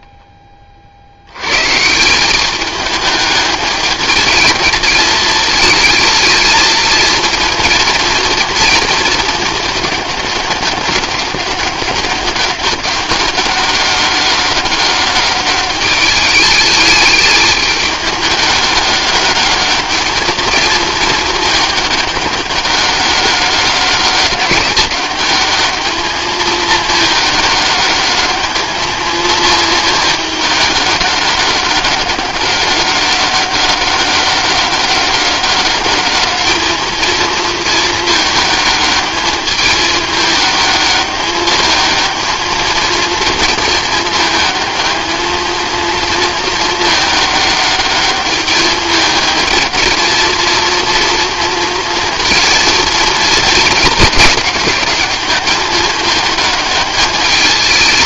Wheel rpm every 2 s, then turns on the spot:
40, 210, 220, 230, 230, 200, 190, 200, 210, 200, 220, 200, 190, 210, 220, 210, 190, 190, 220, 210, 210, 220, 220, 220, 210, 230, 230, 210, 210.
none